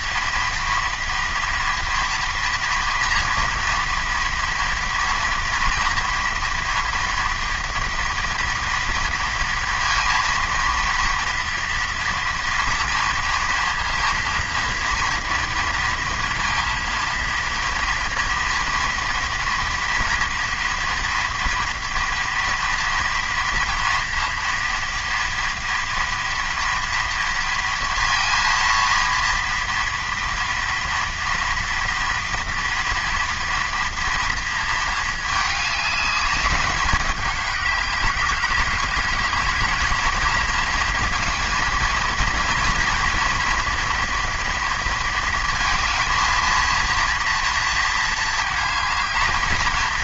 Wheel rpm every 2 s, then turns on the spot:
240, 230, 230, 230, 230, 230, 230, 230, 230, 230, 230, 230, 230, 230, 230, 230, 230, 220, 210, 210, 220, 240, 230, 230, 220.
none